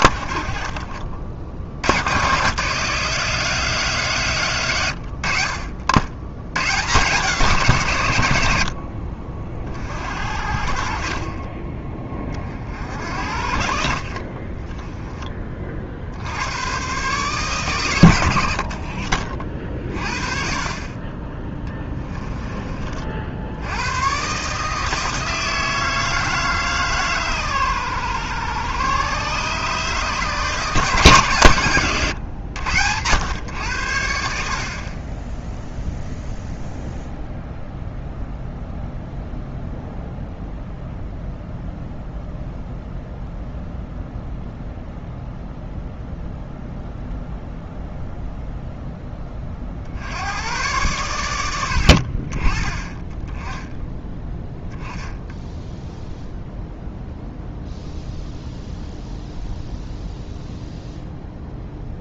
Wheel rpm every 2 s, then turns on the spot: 40, 140, 120, 120, 70, 50, 50, 20, 100, 70, 40, 20, 150, 150, 120, 150, 110, 40, 0, 0, 0, 0, 0, 0, 10, 120, 30, 10, 0, 0, 0.
14-16